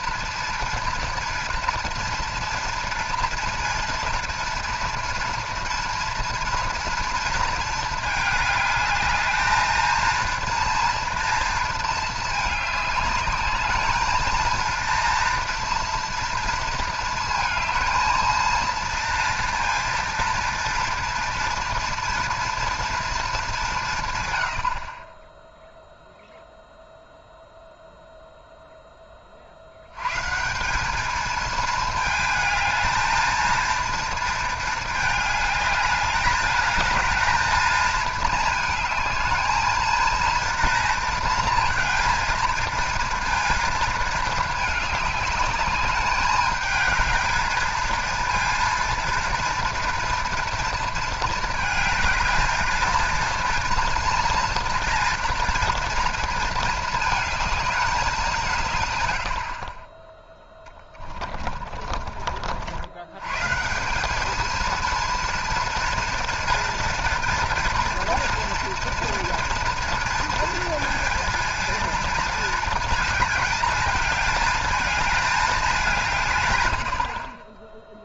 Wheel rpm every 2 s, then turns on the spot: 230, 230, 230, 230, 210, 230, 210, 230, 230, 230, 230, 230, 60, 0, 10, 180, 220, 220, 220, 220, 230, 230, 210, 210, 230, 230, 220, 230, 220, 140, 20, 80, 220, 230, 230, 230, 220, 220, 100.
60-62